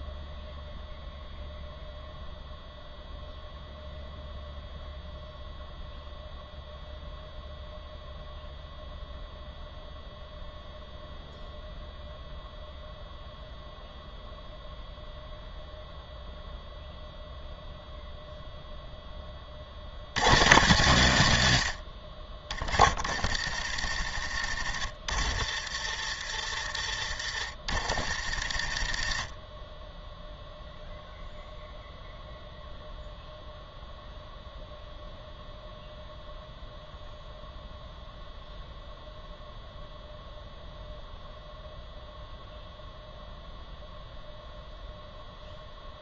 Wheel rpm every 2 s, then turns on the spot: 0, 0, 0, 0, 0, 0, 0, 0, 0, 0, 120, 50, 60, 60, 50, 0, 0, 0, 0, 0, 0, 0, 0.
22-24 28-30